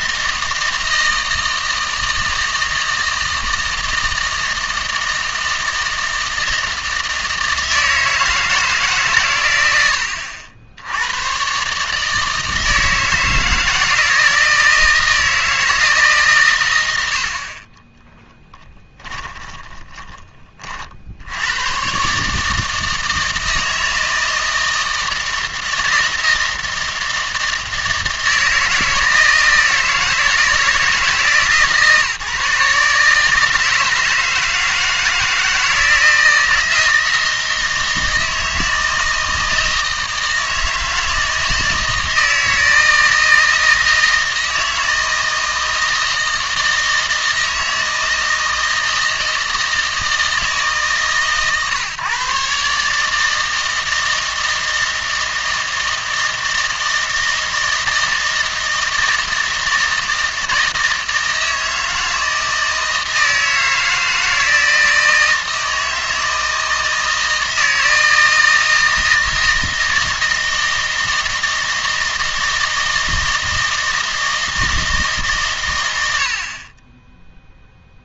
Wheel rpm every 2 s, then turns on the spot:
160, 160, 160, 160, 150, 80, 160, 160, 110, 10, 50, 160, 160, 160, 160, 160, 150, 160, 160, 160, 160, 160, 160, 160, 160, 150, 140, 160, 160, 160, 160, 160, 160, 160, 160, 160, 160, 160, 20.
18-20